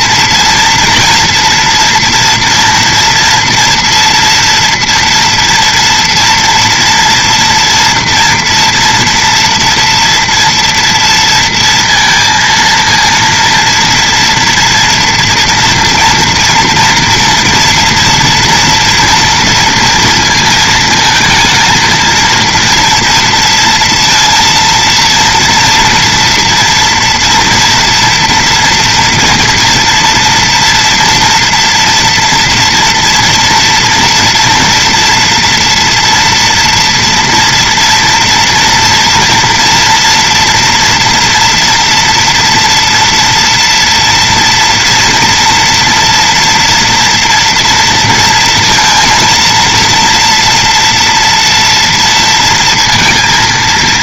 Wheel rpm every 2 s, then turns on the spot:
230, 230, 230, 230, 230, 230, 230, 230, 240, 230, 230, 230, 230, 240, 230, 240, 240, 230, 230, 230, 230, 230, 230, 240, 230, 230, 230.
none